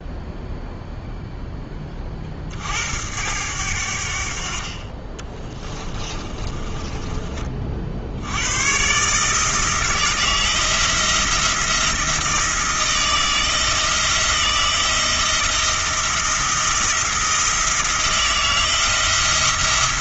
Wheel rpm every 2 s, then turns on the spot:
0, 70, 40, 20, 130, 160, 160, 160, 170, 170.
4-8